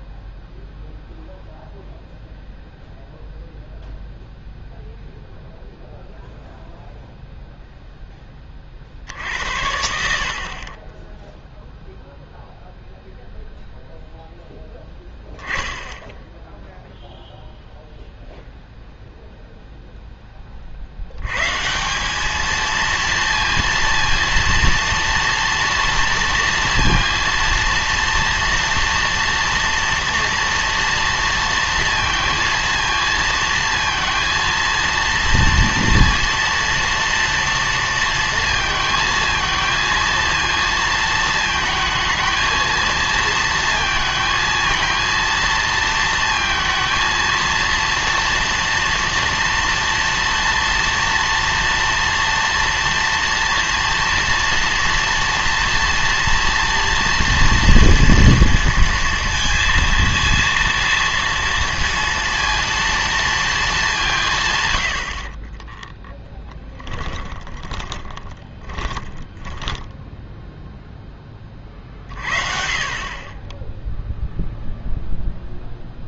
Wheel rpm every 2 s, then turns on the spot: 0, 0, 0, 0, 30, 30, 0, 10, 0, 0, 50, 220, 230, 230, 230, 230, 220, 230, 230, 220, 230, 230, 220, 230, 230, 230, 230, 230, 230, 230, 230, 230, 120, 20, 30, 0, 50, 0.
66-70